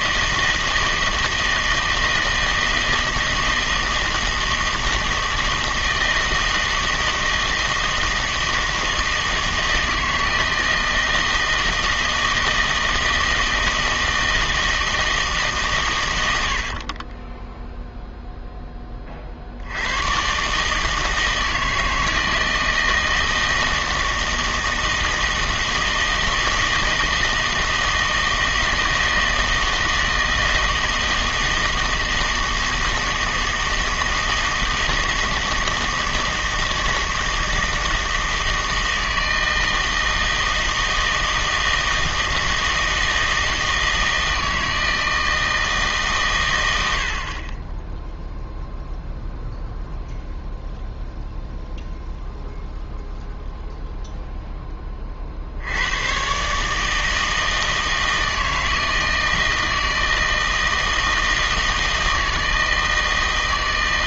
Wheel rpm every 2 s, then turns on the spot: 160, 160, 160, 160, 160, 160, 160, 160, 50, 10, 150, 160, 160, 160, 160, 160, 160, 160, 160, 160, 160, 160, 160, 100, 0, 0, 0, 20, 150, 160, 160, 160.
16-18